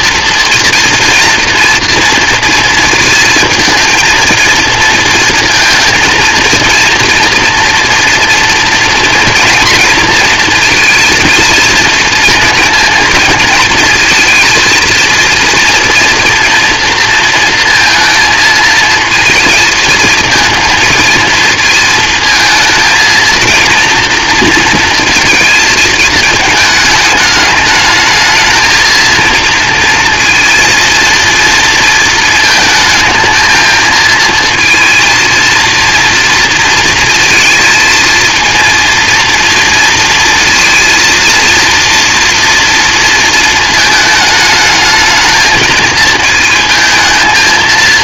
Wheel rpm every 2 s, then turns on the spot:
230, 230, 230, 230, 230, 230, 230, 230, 230, 230, 230, 220, 230, 210, 230, 230, 220, 220, 230, 220, 230, 230, 220, 230.
none